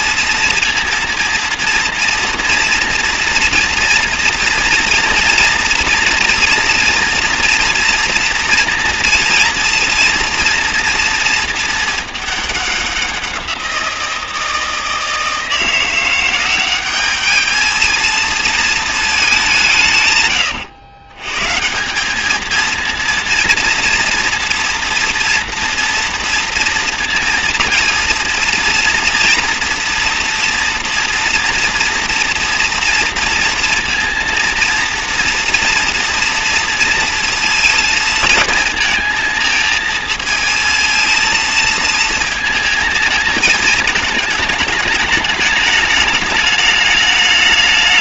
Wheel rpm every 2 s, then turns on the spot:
230, 230, 230, 230, 230, 230, 200, 160, 190, 230, 110, 220, 230, 230, 230, 230, 230, 230, 230, 230, 230, 220, 220, 210.
none